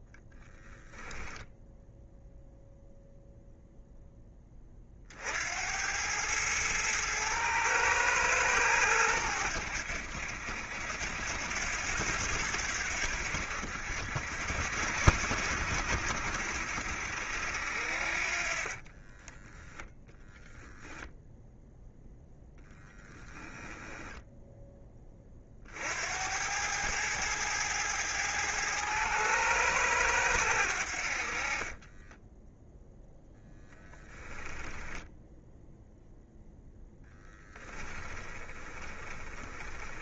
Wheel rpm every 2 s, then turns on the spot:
10, 0, 50, 110, 100, 80, 80, 70, 70, 30, 0, 10, 20, 100, 110, 70, 0, 10, 0, 20.
0-2 18-20 22-24 38-40